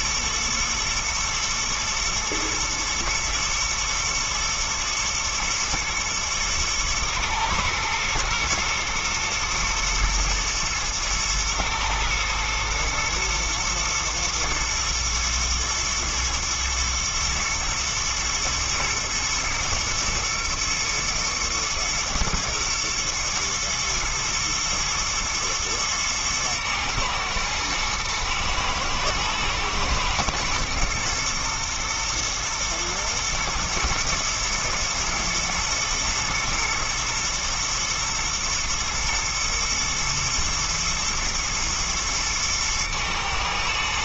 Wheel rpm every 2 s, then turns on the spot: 110, 120, 110, 110, 120, 110, 110, 110, 110, 120, 120, 120, 110, 110, 110, 120, 110, 110, 120, 120, 120, 120.
none